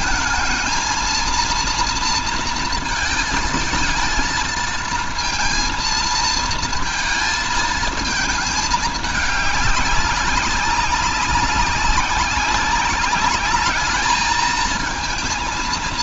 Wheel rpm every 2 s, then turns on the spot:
220, 230, 230, 220, 210, 190, 200, 220.
none